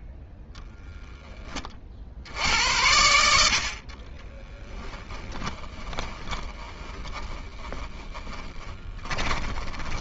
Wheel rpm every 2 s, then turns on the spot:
10, 70, 20, 10, 10.
0-2 4-10